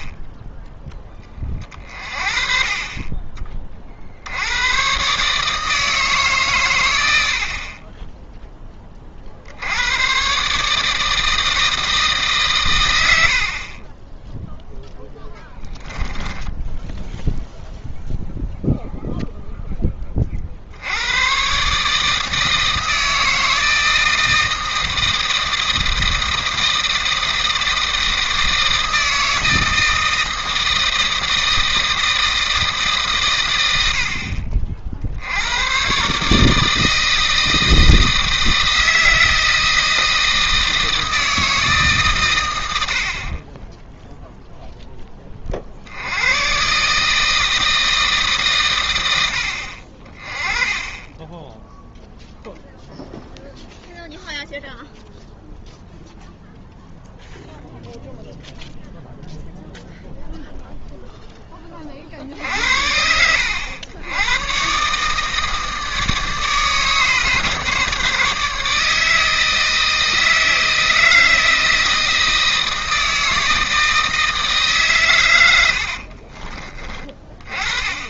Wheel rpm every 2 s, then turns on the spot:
10, 30, 120, 120, 20, 150, 120, 10, 10, 0, 70, 160, 160, 160, 160, 160, 150, 60, 160, 160, 160, 80, 0, 130, 120, 20, 0, 0, 0, 0, 0, 60, 140, 150, 150, 160, 160, 140, 30.
16-18